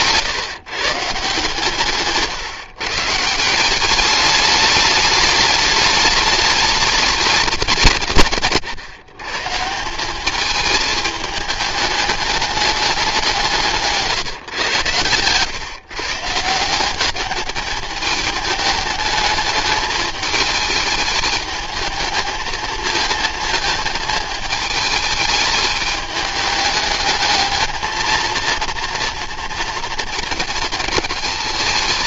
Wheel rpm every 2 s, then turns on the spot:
150, 150, 210, 210, 150, 220, 200, 130, 180, 210, 210, 220, 220, 210, 230, 220.
none